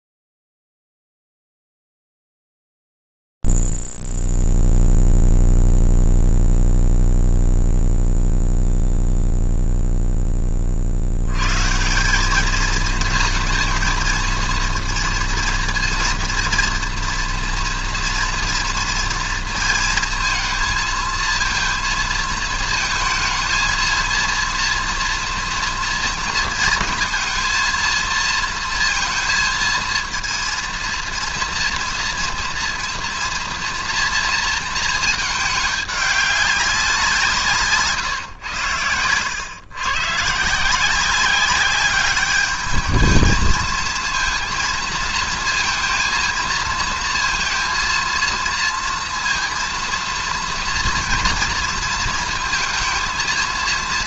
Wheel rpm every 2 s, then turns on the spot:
0, 0, 0, 0, 0, 10, 200, 230, 230, 230, 230, 230, 230, 230, 230, 230, 240, 230, 200, 110, 160, 210, 230, 230, 230, 230, 230.
38-40